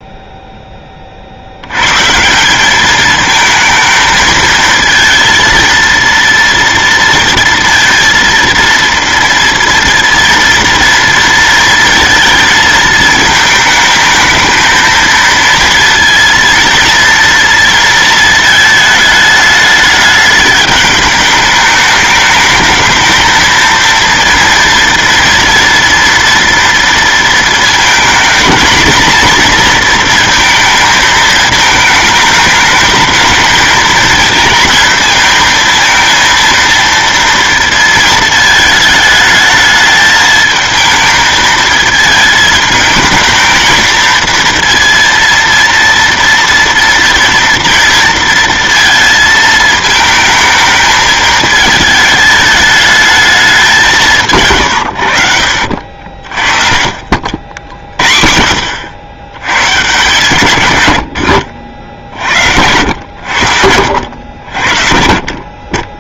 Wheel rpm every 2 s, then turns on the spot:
20, 200, 220, 230, 230, 230, 220, 220, 230, 220, 210, 220, 230, 230, 230, 220, 220, 230, 230, 220, 220, 220, 230, 230, 230, 220, 220, 120, 60, 80, 110, 90, 50.
54-56